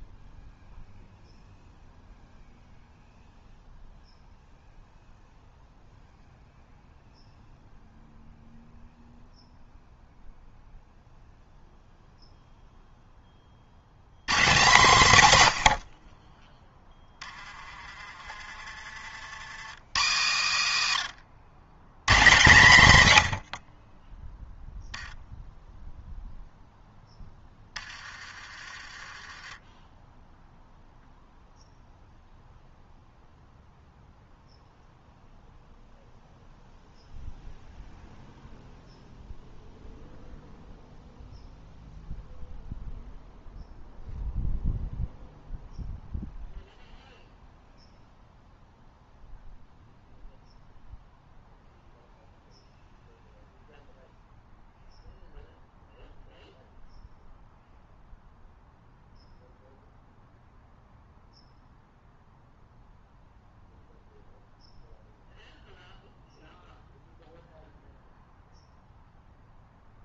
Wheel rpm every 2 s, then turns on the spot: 0, 0, 0, 0, 0, 0, 0, 180, 10, 30, 80, 140, 0, 0, 30, 0, 0, 0, 0, 0, 0, 0, 0, 0, 0, 0, 0, 0, 0, 0, 0, 0, 0, 0, 0.
none